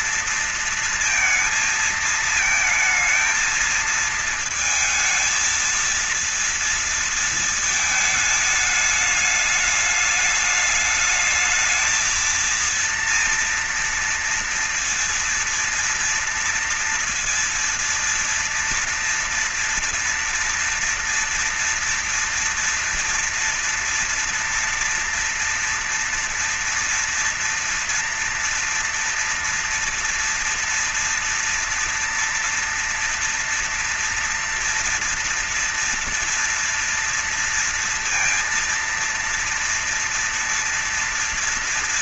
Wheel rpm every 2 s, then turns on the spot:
230, 220, 230, 230, 210, 210, 230, 230, 230, 230, 230, 230, 230, 230, 230, 240, 230, 230, 230, 230, 230.
none